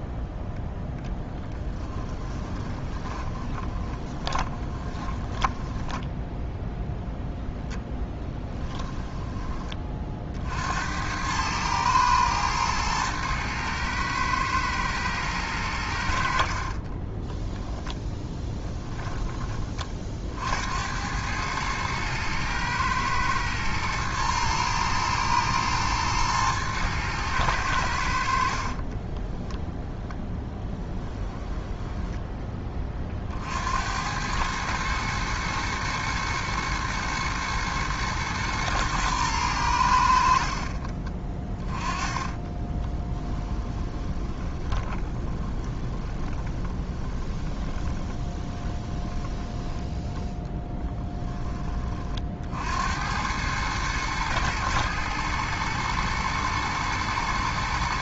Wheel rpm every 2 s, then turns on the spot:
0, 20, 20, 0, 10, 70, 110, 110, 30, 10, 80, 110, 110, 110, 30, 10, 30, 110, 110, 120, 40, 20, 20, 20, 10, 10, 70, 110, 120.
2-6 8-10 16-20 28-32 42-50